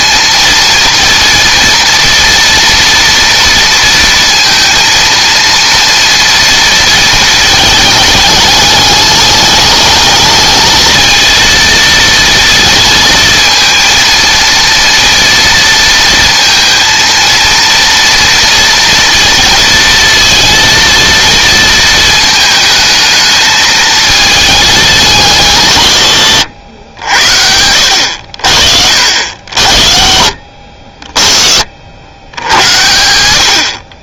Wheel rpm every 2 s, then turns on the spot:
230, 230, 230, 230, 210, 220, 230, 230, 230, 230, 230, 220, 190, 80, 70, 50, 90.
none